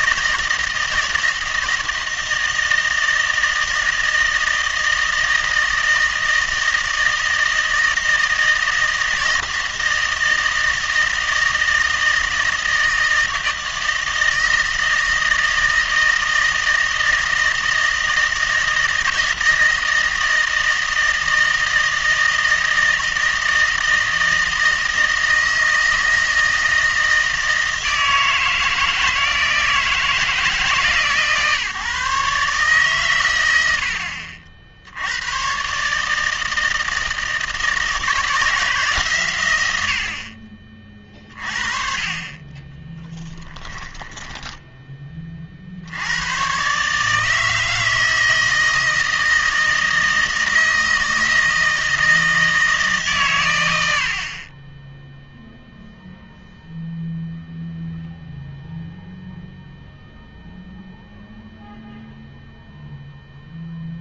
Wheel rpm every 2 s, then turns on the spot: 160, 160, 160, 160, 160, 160, 160, 160, 160, 160, 160, 160, 160, 160, 160, 150, 140, 70, 160, 150, 30, 10, 10, 130, 160, 160, 150, 20, 0, 0, 0, 0.
42-44